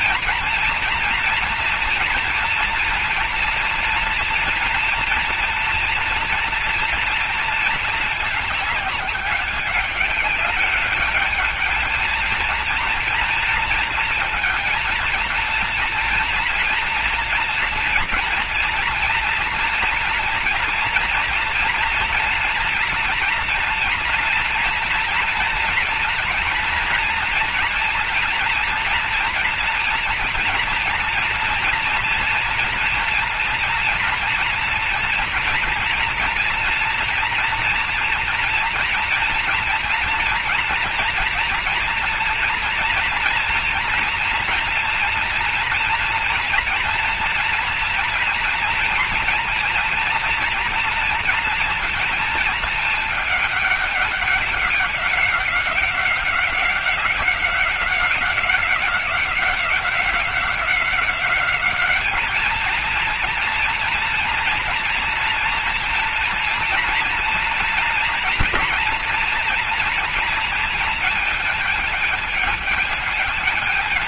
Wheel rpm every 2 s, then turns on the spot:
240, 240, 240, 230, 210, 210, 230, 220, 230, 230, 230, 230, 230, 230, 240, 240, 230, 230, 230, 230, 230, 230, 230, 230, 240, 230, 230, 200, 190, 190, 190, 220, 230, 230, 230, 230, 220.
none